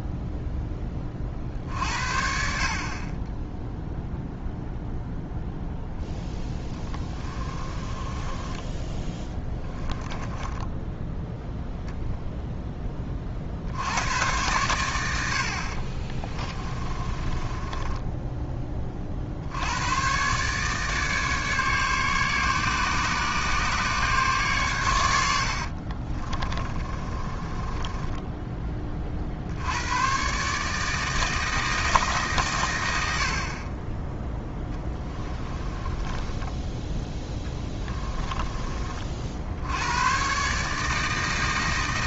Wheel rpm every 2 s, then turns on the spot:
10, 40, 0, 10, 20, 10, 10, 100, 30, 30, 150, 140, 120, 30, 20, 150, 100, 10, 10, 30, 150.
6-8 10-12 16-18 26-28 34-38